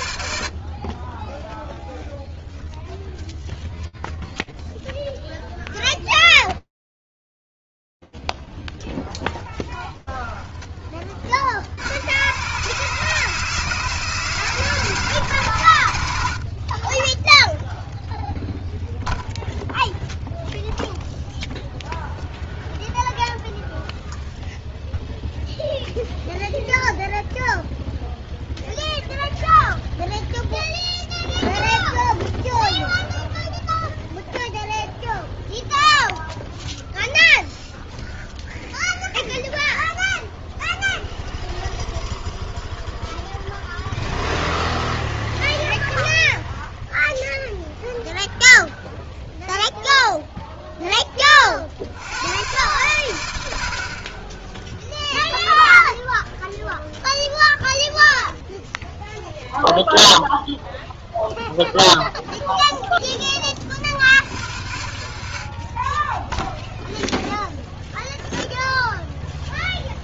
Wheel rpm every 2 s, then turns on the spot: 0, 0, 0, 0, 80, 150, 110, 0, 0, 0, 0, 0, 0, 0, 0, 0, 0, 0, 0, 0, 0, 0, 0, 0, 0, 80, 40, 0, 0, 0, 0, 70, 20, 0, 40.
none